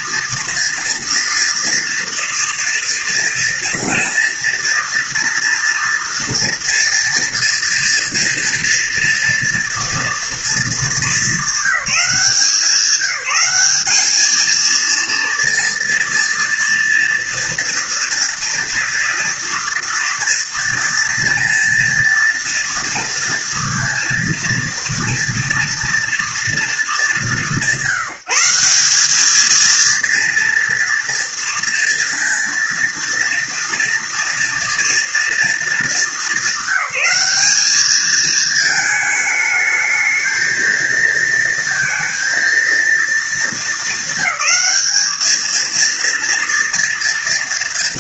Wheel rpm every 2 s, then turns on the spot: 240, 230, 230, 230, 230, 220, 190, 230, 230, 230, 230, 230, 230, 200, 190, 230, 230, 230, 200, 220, 230, 230, 220, 230.
none